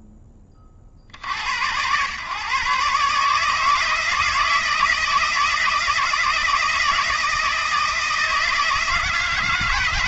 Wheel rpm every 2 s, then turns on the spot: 60, 150, 160, 160, 160.
none